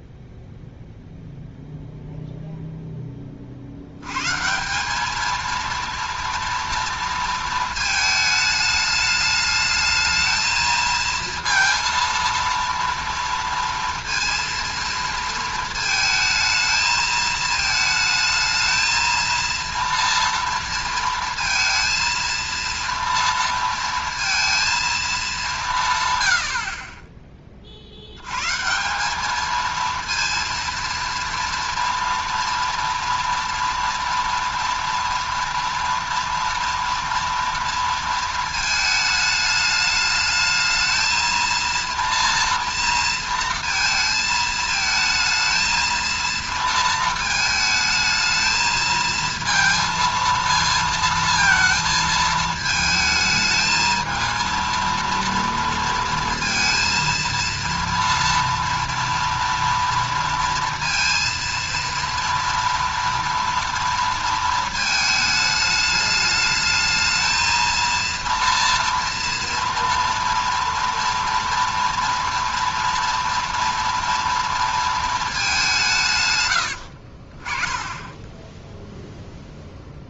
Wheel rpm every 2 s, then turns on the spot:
0, 0, 160, 230, 210, 220, 230, 230, 220, 220, 230, 230, 230, 70, 140, 230, 230, 230, 230, 220, 220, 230, 220, 230, 220, 230, 220, 230, 230, 230, 230, 230, 220, 210, 230, 230, 230, 230, 100, 20.
76-80